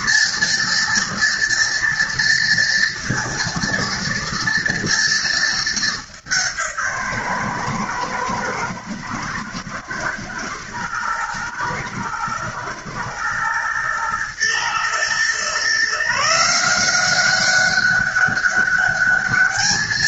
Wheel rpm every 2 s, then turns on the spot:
230, 230, 230, 150, 110, 110, 110, 120, 180, 200.
none